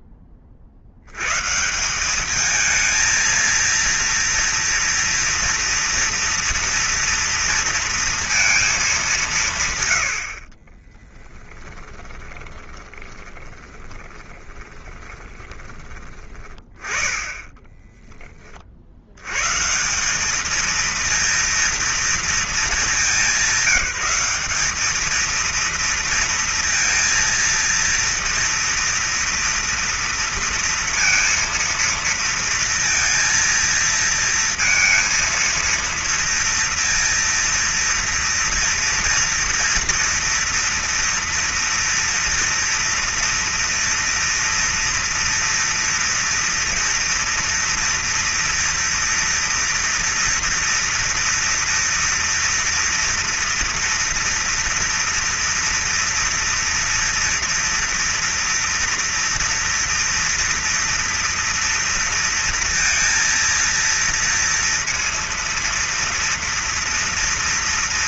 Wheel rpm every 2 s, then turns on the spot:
60, 220, 230, 230, 220, 30, 20, 20, 20, 70, 230, 190, 220, 230, 230, 230, 230, 230, 230, 230, 230, 230, 230, 230, 230, 230, 230, 230, 230, 230, 230, 230, 230, 230.
10-16